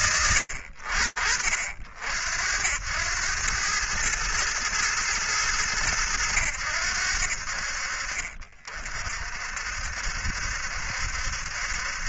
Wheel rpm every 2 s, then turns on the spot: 30, 80, 110, 80, 50, 70.
none